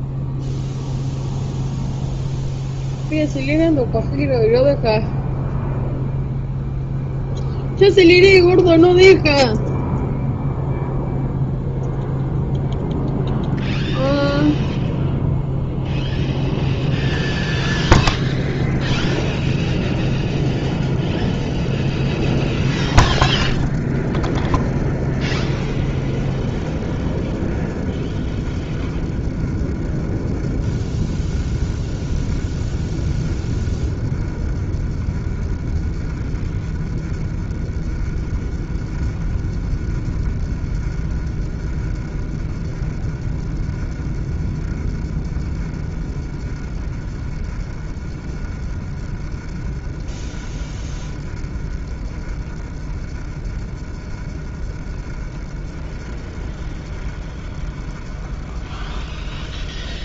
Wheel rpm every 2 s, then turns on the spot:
0, 0, 0, 0, 0, 0, 0, 0, 10, 30, 30, 30, 30, 30, 30, 30, 30, 30, 30, 30, 30, 30, 30, 30, 30, 30, 30, 30, 30, 30.
18-20